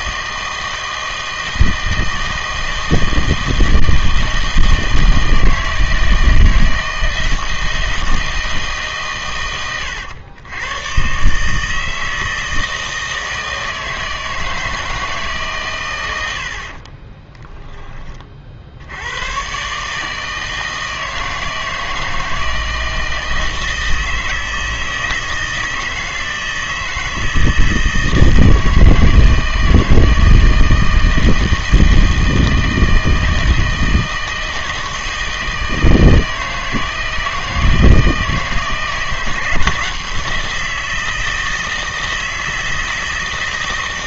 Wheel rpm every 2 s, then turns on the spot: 160, 160, 160, 160, 160, 110, 160, 160, 50, 60, 160, 160, 160, 160, 160, 160, 160, 160, 160, 160, 160, 160.
none